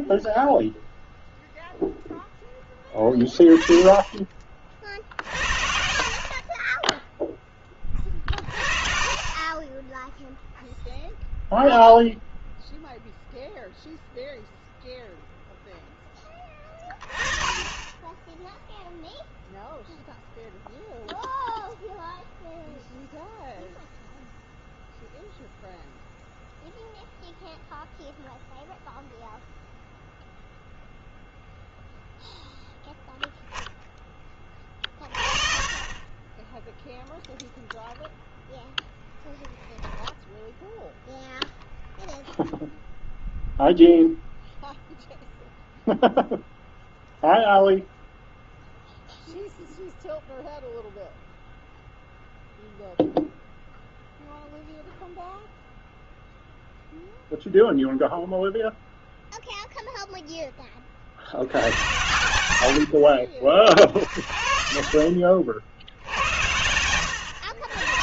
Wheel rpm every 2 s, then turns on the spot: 0, 10, 50, 10, 30, 0, 0, 0, 30, 0, 0, 0, 0, 0, 0, 0, 0, 30, 0, 0, 0, 0, 0, 0, 0, 0, 0, 0, 0, 0, 60, 60, 60, 90.
62-64